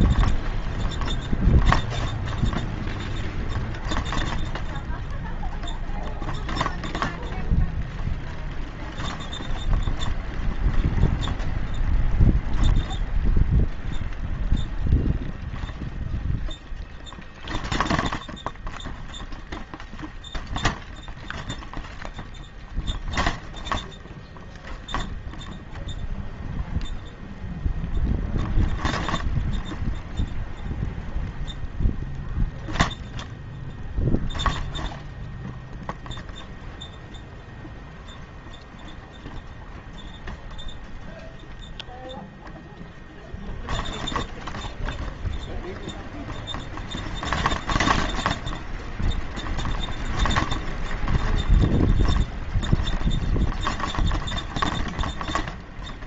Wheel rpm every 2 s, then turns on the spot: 0, 0, 0, 0, 0, 0, 0, 0, 0, 0, 0, 0, 0, 0, 0, 0, 0, 0, 0, 0, 0, 0, 0, 0, 0, 0, 0, 0.
none